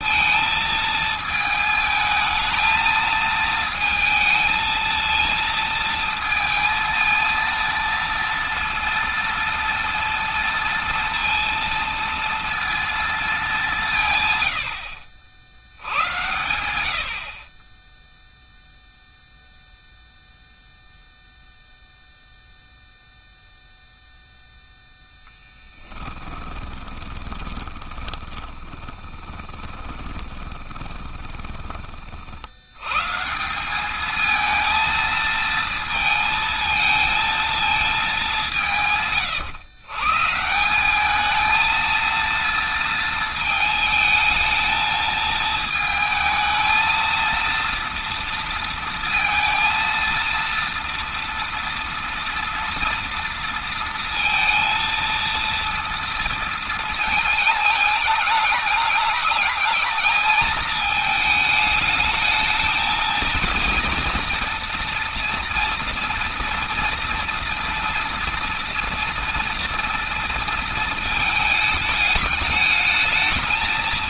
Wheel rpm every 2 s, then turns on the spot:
220, 220, 230, 230, 230, 230, 230, 80, 90, 0, 0, 0, 0, 20, 30, 20, 110, 230, 220, 160, 190, 230, 220, 220, 230, 230, 230, 230, 230, 210, 220, 220, 230, 230, 240, 230, 210.
26-32